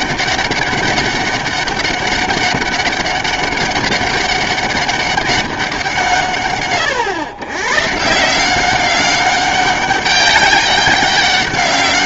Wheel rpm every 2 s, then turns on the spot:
200, 200, 200, 110, 180, 200.
none